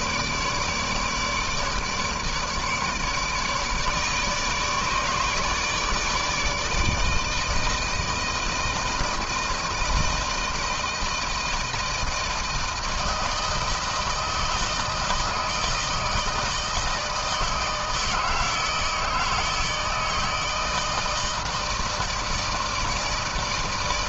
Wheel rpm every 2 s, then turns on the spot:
150, 150, 150, 160, 160, 160, 160, 160, 160, 160, 160, 160.
none